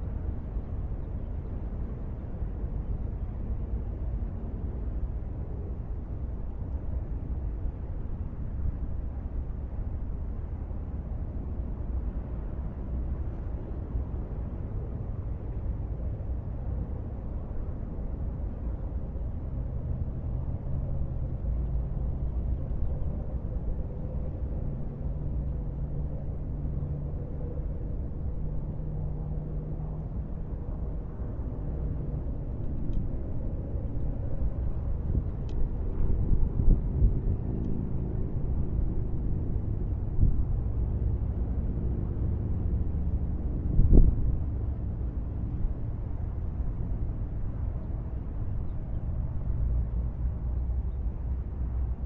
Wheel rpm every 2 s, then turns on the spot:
0, 0, 0, 0, 0, 0, 0, 0, 0, 0, 0, 0, 0, 0, 0, 0, 0, 0, 0, 0, 0, 0, 0, 0, 0, 0.
none